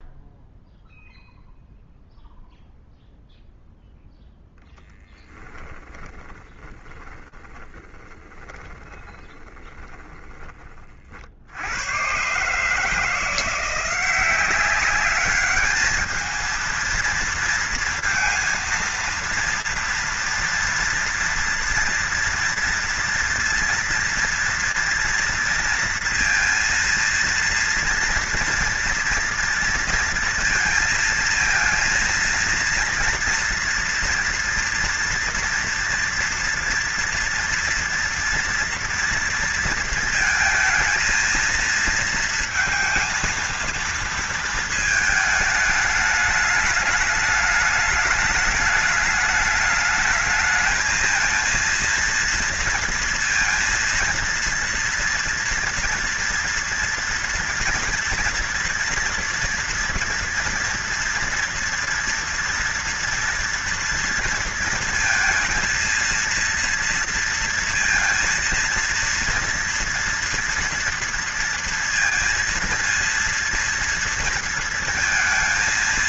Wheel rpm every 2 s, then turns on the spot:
0, 0, 0, 20, 20, 20, 140, 190, 220, 230, 230, 230, 230, 230, 230, 230, 230, 230, 230, 230, 220, 230, 230, 210, 210, 220, 230, 230, 240, 230, 230, 230, 230, 230, 230, 230, 230, 230.
6-10